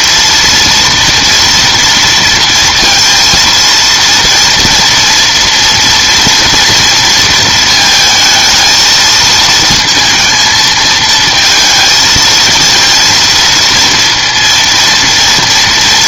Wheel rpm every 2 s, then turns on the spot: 230, 230, 230, 230, 220, 220, 230, 230.
none